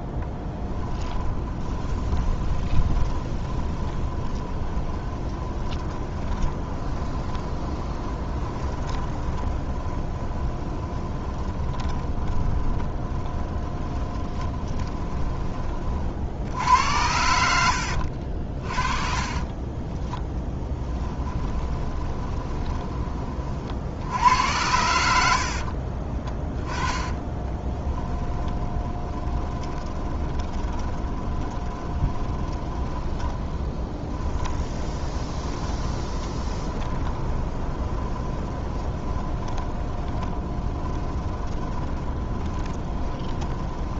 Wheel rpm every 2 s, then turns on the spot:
20, 20, 20, 20, 20, 20, 20, 20, 80, 40, 10, 20, 90, 20, 10, 20, 20, 20, 30, 20, 20, 20.
0-16 20-24 26-44